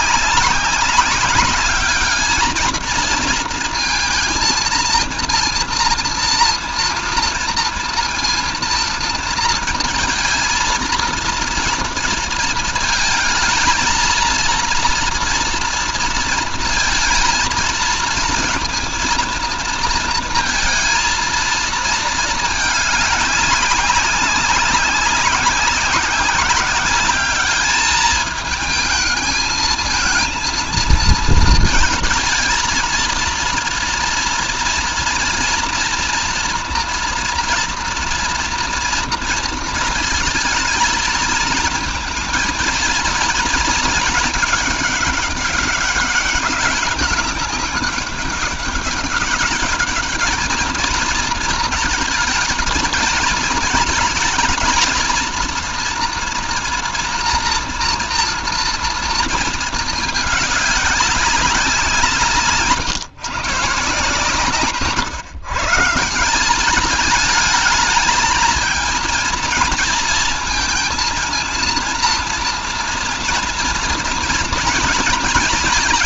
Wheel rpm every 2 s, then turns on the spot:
200, 230, 230, 230, 230, 230, 220, 230, 230, 230, 230, 200, 200, 210, 220, 230, 230, 230, 230, 230, 230, 230, 200, 200, 200, 220, 220, 230, 240, 220, 190, 140, 140, 210, 230, 230, 230, 230.
none